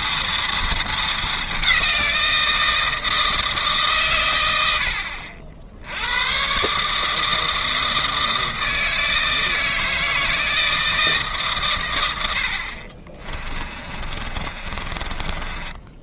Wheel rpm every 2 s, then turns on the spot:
220, 160, 70, 150, 160, 160, 50, 40.
12-16